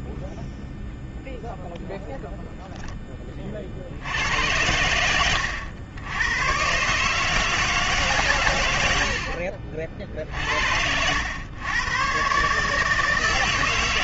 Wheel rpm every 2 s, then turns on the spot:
0, 0, 80, 130, 130, 60, 140.
none